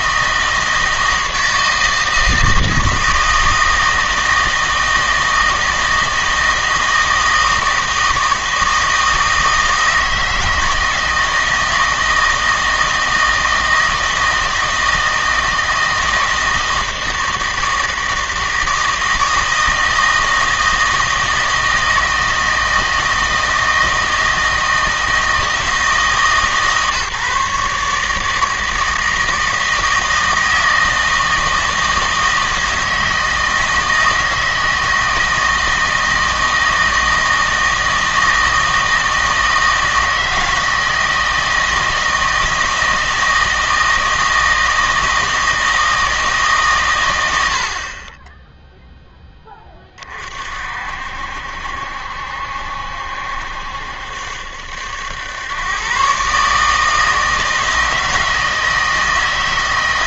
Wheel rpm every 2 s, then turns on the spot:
160, 160, 160, 160, 160, 160, 160, 160, 160, 160, 160, 160, 160, 150, 160, 160, 160, 160, 160, 160, 160, 160, 160, 130, 0, 60, 70, 80, 150, 160.
none